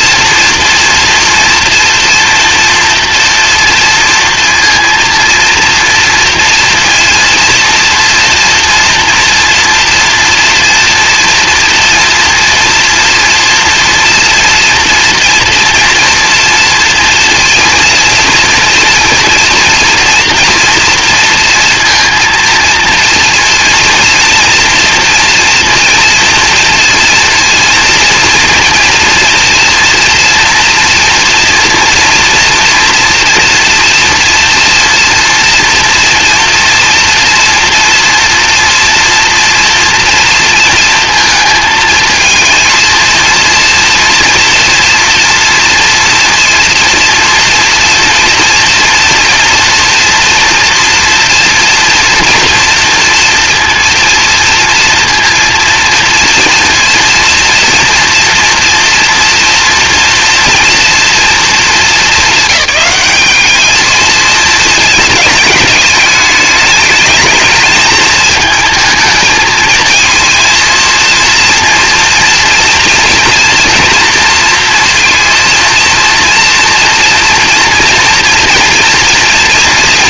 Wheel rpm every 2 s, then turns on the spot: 230, 230, 230, 230, 230, 230, 230, 230, 230, 230, 230, 230, 230, 230, 230, 230, 230, 230, 240, 230, 230, 230, 240, 230, 230, 230, 230, 230, 230, 240, 230, 210, 230, 210, 220, 230, 230, 230, 230, 230.
none